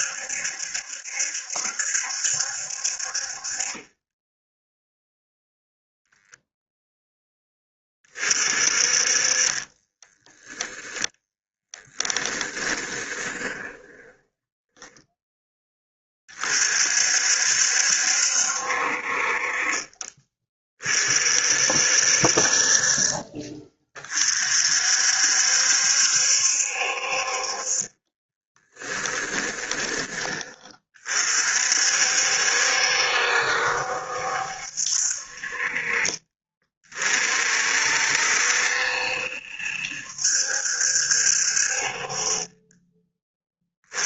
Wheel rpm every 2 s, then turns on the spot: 70, 50, 0, 0, 40, 10, 20, 10, 50, 60, 40, 40, 60, 60, 20, 40, 70, 60, 40, 70, 60, 20.
8-10 12-16 28-30